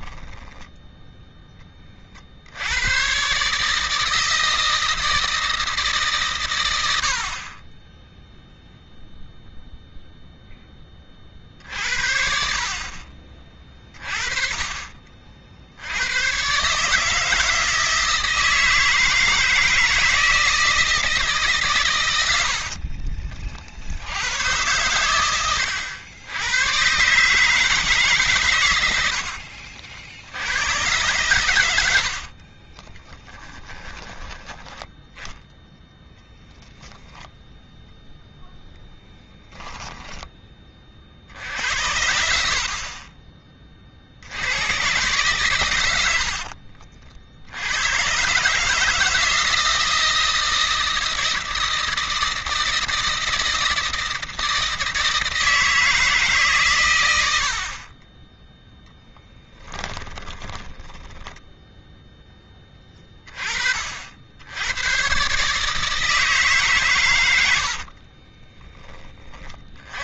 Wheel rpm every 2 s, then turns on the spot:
10, 70, 160, 130, 0, 10, 50, 30, 120, 160, 160, 70, 110, 110, 120, 80, 50, 10, 0, 0, 20, 60, 90, 60, 120, 160, 160, 160, 140, 20, 10, 10, 90, 150, 20.
22-24 32-34 46-48 60-62 68-70